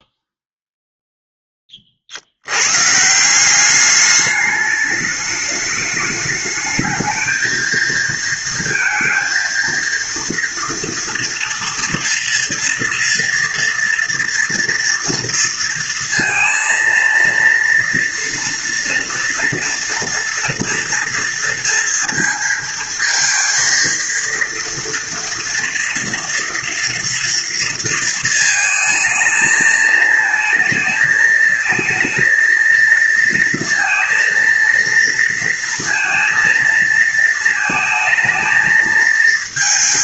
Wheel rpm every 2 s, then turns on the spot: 0, 130, 210, 220, 230, 230, 230, 230, 230, 230, 230, 230, 230, 230, 220, 230, 230, 230, 230, 220.
none